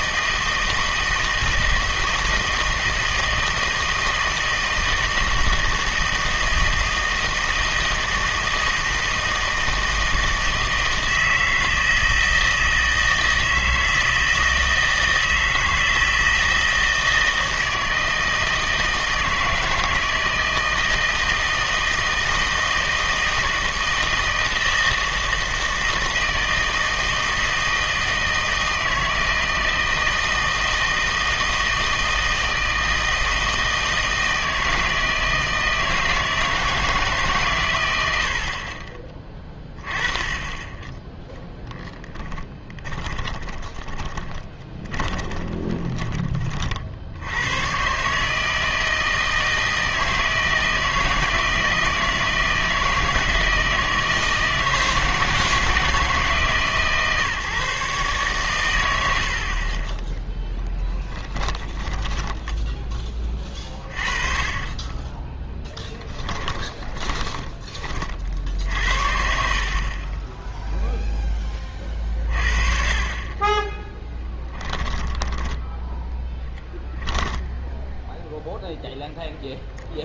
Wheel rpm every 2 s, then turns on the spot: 160, 160, 160, 160, 160, 160, 160, 160, 160, 160, 160, 160, 160, 160, 160, 160, 160, 160, 160, 40, 10, 20, 20, 40, 160, 160, 160, 160, 150, 110, 10, 10, 30, 10, 60, 0, 40, 10, 10, 0.
42-46 62-64 66-68 74-78